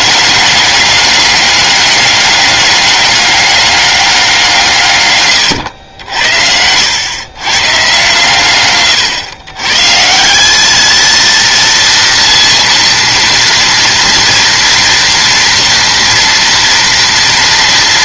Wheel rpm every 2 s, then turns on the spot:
200, 200, 140, 90, 130, 210, 230, 240, 230.
none